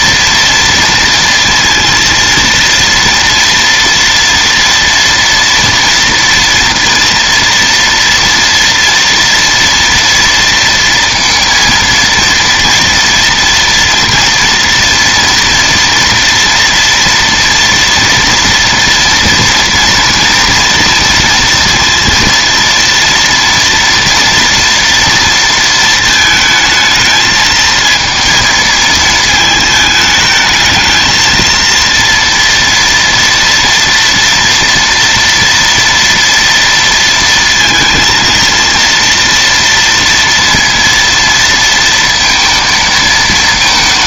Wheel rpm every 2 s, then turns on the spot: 230, 230, 230, 230, 230, 230, 230, 230, 240, 230, 230, 230, 230, 220, 220, 220, 230, 240, 240, 230, 230, 230.
none